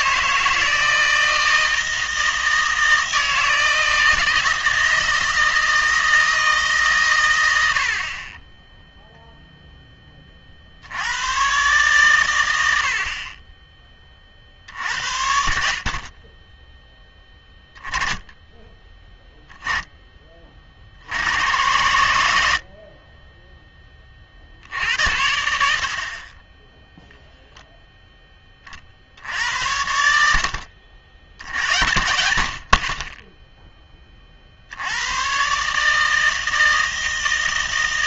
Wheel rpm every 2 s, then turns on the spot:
160, 160, 160, 150, 0, 60, 80, 60, 10, 10, 60, 60, 70, 10, 40, 70, 50, 70, 160.
none